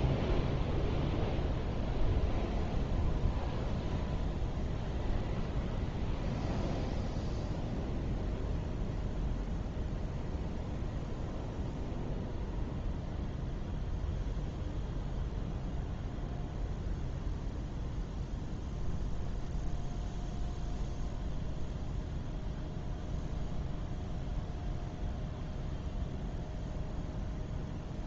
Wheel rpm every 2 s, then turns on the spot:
0, 0, 0, 0, 0, 0, 0, 0, 0, 0, 0, 0, 0, 0.
none